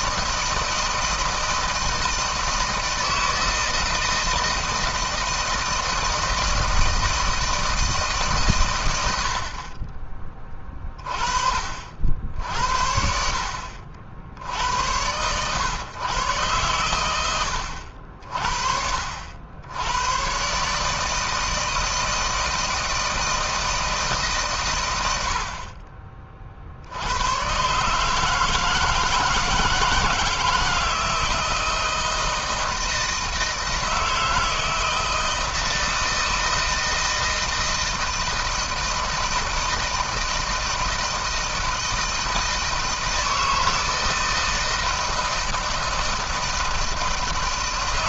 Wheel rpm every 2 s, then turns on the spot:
160, 160, 160, 160, 120, 30, 70, 90, 120, 60, 130, 160, 140, 40, 160, 160, 160, 160, 160, 160, 160, 160, 160, 160.
none